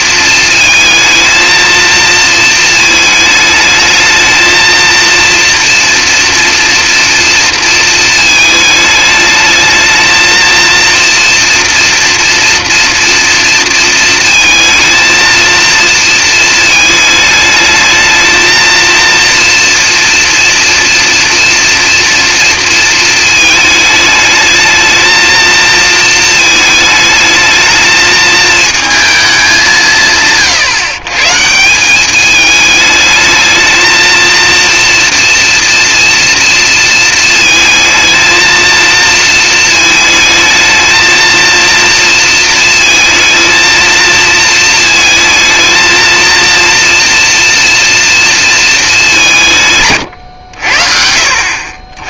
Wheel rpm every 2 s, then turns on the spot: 220, 220, 230, 230, 220, 230, 230, 230, 220, 230, 230, 230, 220, 220, 220, 140, 210, 240, 230, 220, 220, 230, 220, 230, 220, 70.
none